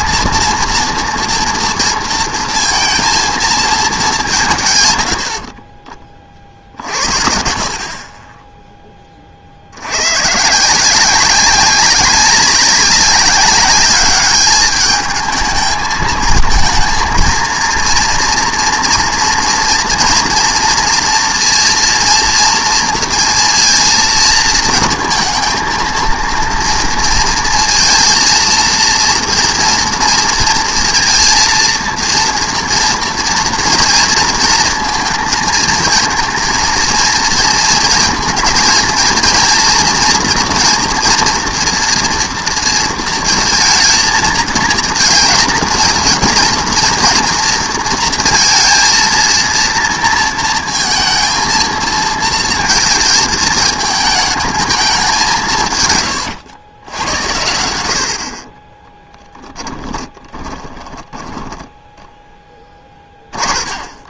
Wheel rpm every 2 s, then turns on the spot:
230, 230, 150, 50, 10, 150, 190, 210, 220, 240, 230, 230, 230, 230, 230, 230, 230, 230, 220, 230, 240, 230, 230, 230, 230, 230, 230, 220, 100, 40, 20, 10.
58-64